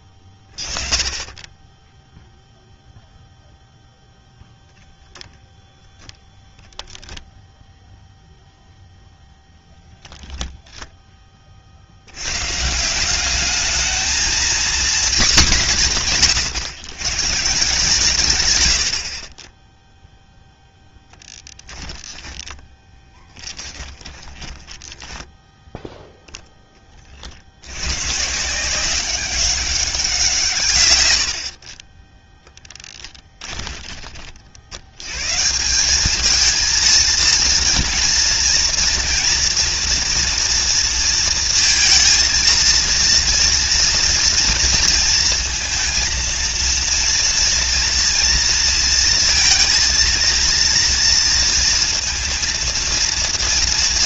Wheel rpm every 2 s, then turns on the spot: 10, 0, 0, 0, 0, 110, 230, 150, 130, 0, 10, 20, 0, 110, 190, 40, 10, 170, 230, 230, 230, 240, 230, 230, 230, 230, 230.
20-24 32-34